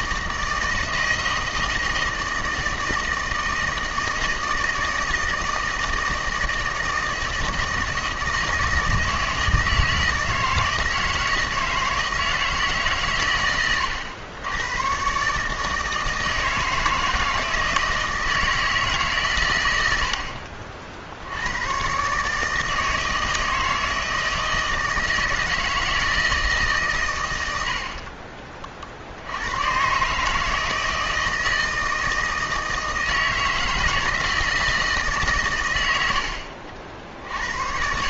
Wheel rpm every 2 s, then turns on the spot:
160, 160, 160, 160, 160, 160, 160, 100, 160, 160, 60, 150, 160, 150, 40, 150, 160, 160, 70.
none